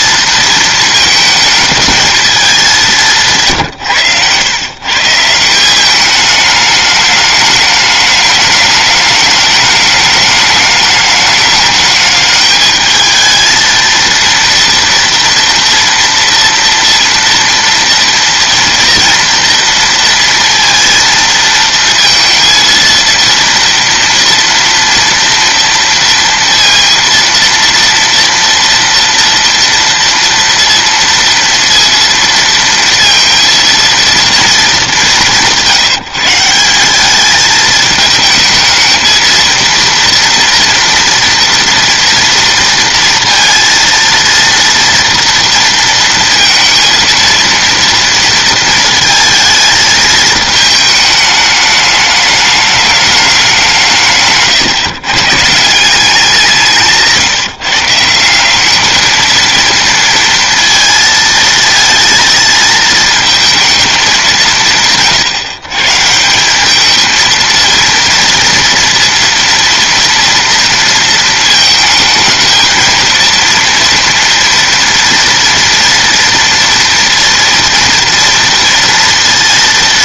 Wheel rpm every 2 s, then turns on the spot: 230, 200, 130, 210, 210, 210, 220, 230, 230, 230, 230, 230, 230, 230, 230, 230, 230, 220, 170, 220, 230, 230, 230, 230, 230, 220, 210, 140, 170, 200, 230, 220, 170, 200, 230, 230, 220, 230, 230, 230.
none